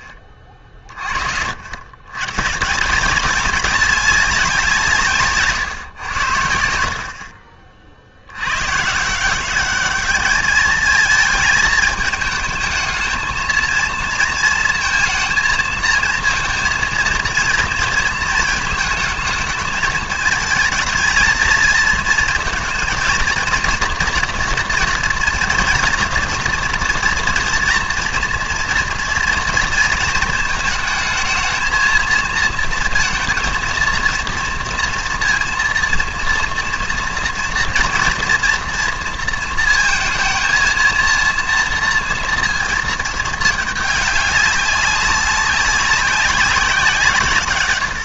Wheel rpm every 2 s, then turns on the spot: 30, 150, 190, 70, 110, 210, 220, 230, 230, 220, 220, 230, 230, 240, 230, 220, 230, 230, 230, 230, 230, 230, 200, 180.
none